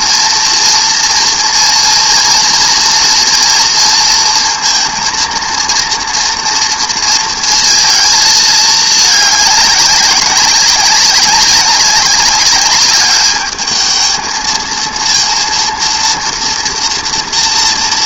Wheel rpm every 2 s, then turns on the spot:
230, 230, 230, 230, 210, 200, 210, 230, 230.
none